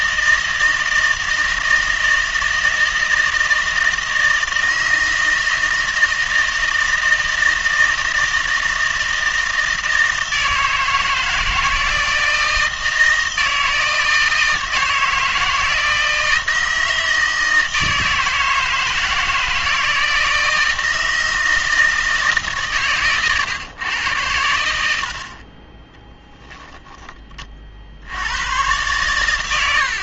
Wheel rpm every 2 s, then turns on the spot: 160, 160, 160, 160, 160, 160, 160, 160, 160, 160, 160, 130, 80, 10, 110.
none